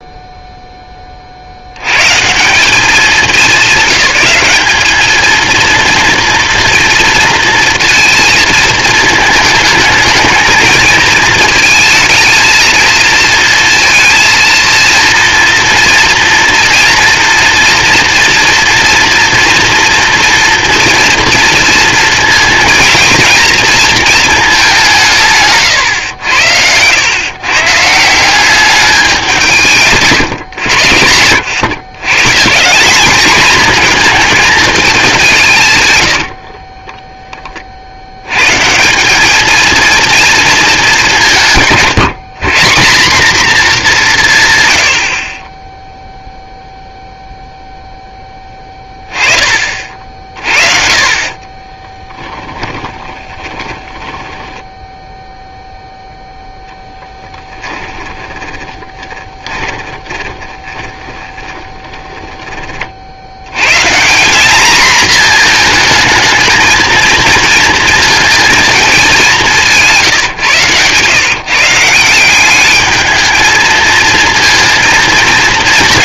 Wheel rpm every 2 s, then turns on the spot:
30, 200, 220, 230, 220, 220, 230, 230, 230, 230, 230, 230, 160, 110, 190, 80, 200, 210, 20, 150, 210, 180, 110, 0, 10, 40, 10, 10, 0, 20, 20, 20, 220, 230, 220, 130, 200, 230.
36-38 52-56 58-62